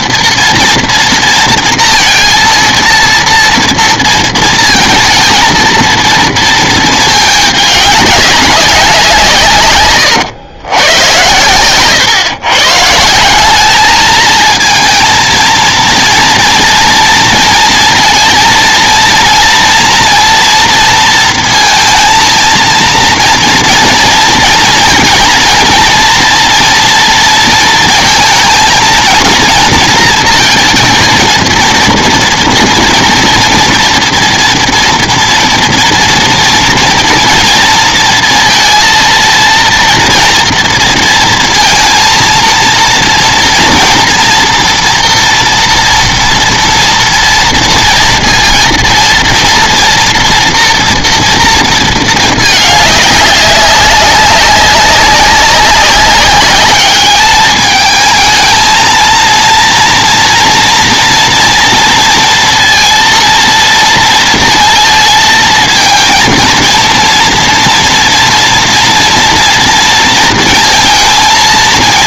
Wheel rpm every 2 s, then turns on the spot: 230, 230, 220, 220, 190, 120, 130, 230, 230, 230, 230, 230, 240, 240, 230, 230, 230, 230, 230, 230, 230, 230, 230, 230, 230, 240, 210, 190, 200, 220, 230, 230, 230, 230, 230, 230.
none